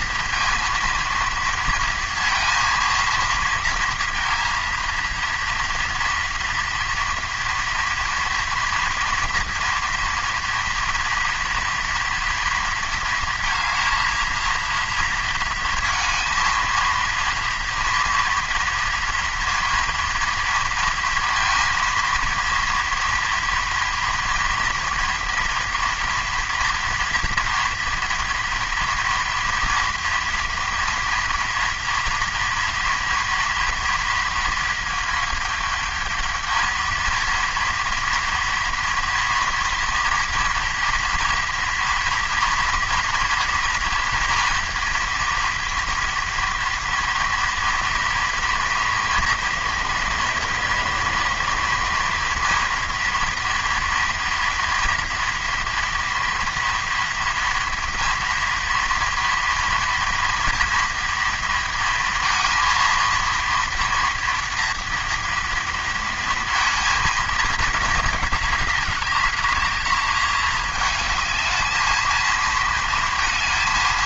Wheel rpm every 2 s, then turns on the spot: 230, 230, 230, 230, 230, 230, 230, 230, 230, 230, 230, 230, 240, 240, 230, 230, 230, 230, 220, 230, 230, 230, 230, 230, 240, 230, 230, 230, 230, 230, 230, 230, 230, 230, 210, 210, 230.
none